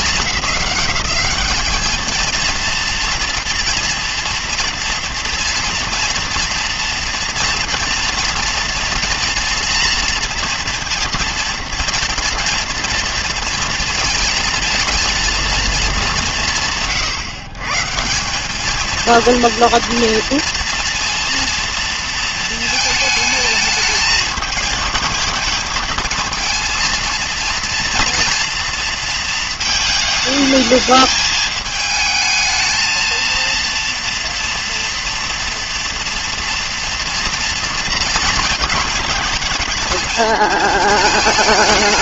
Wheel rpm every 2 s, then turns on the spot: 200, 230, 230, 230, 230, 230, 230, 230, 150, 210, 230, 220, 220, 230, 230, 220, 220, 230, 230, 220, 220.
none